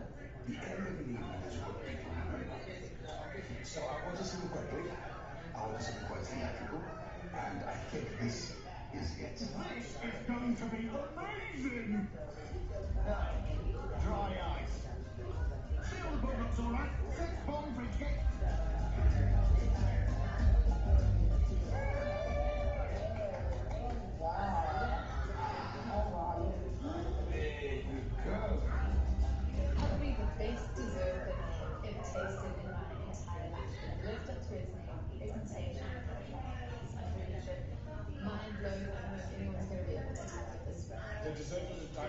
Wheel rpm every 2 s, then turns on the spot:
0, 0, 0, 0, 0, 0, 0, 0, 0, 0, 0, 0, 0, 0, 0, 0, 0, 0, 0, 0, 0.
none